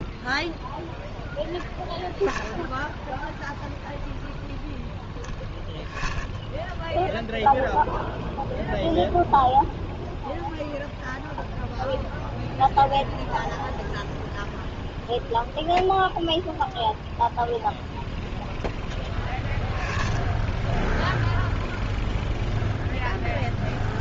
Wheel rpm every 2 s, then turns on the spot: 0, 0, 10, 0, 0, 0, 0, 0, 0, 10, 0, 0.
none